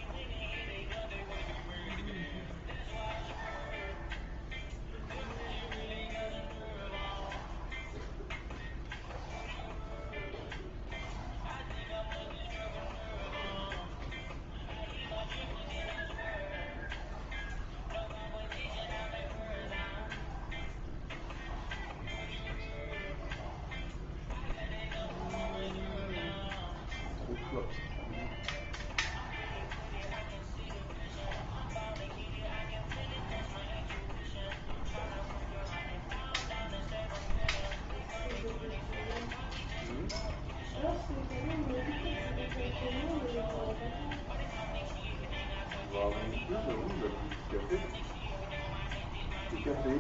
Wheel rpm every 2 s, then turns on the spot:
0, 0, 0, 0, 0, 0, 0, 0, 0, 0, 0, 0, 0, 0, 0, 0, 0, 0, 0, 0, 0, 0, 0, 0, 0.
none